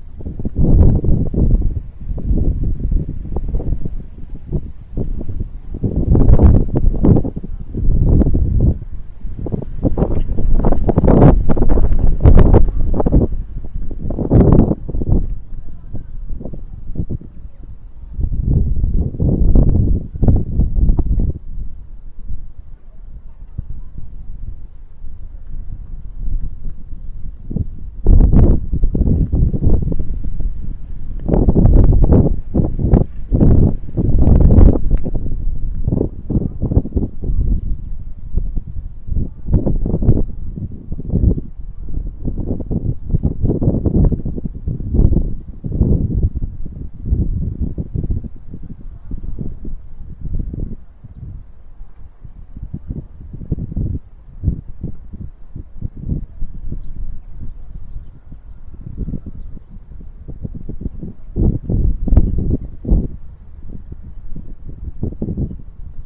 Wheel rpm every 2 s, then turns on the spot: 0, 0, 0, 0, 0, 0, 0, 0, 0, 0, 0, 0, 0, 0, 0, 0, 0, 0, 0, 0, 0, 0, 0, 0, 0, 0, 0, 0, 0, 0, 0, 0, 0.
none